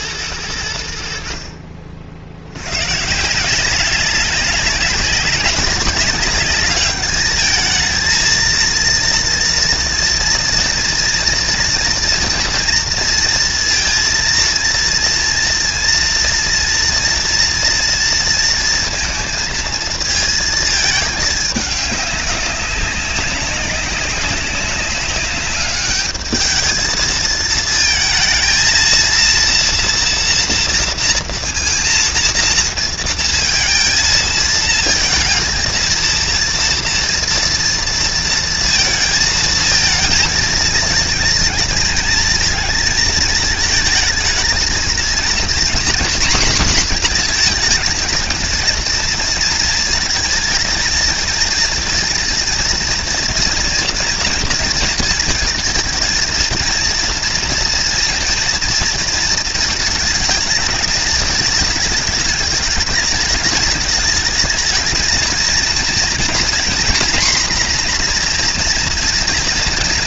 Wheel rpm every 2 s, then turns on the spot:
70, 140, 200, 210, 230, 230, 230, 230, 230, 230, 210, 200, 200, 220, 230, 230, 230, 220, 230, 220, 230, 220, 230, 230, 230, 220, 230, 230, 230, 230, 220, 220, 220, 250, 240.
none